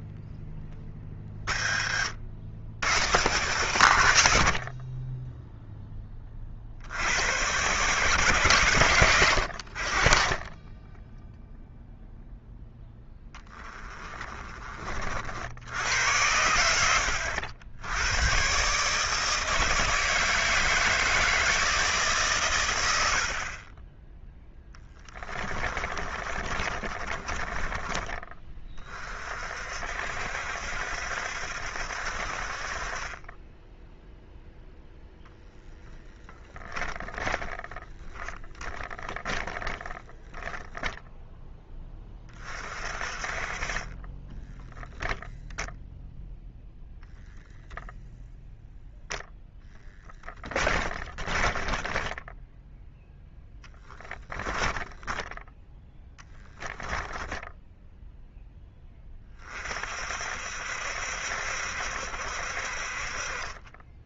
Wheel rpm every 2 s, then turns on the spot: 40, 120, 10, 120, 70, 0, 10, 70, 90, 160, 160, 30, 20, 20, 50, 70, 20, 0, 20, 10, 10, 40, 0, 0, 0, 30, 0, 10, 20, 20, 70, 50.
0-2 12-14 24-28 36-40 50-52 54-58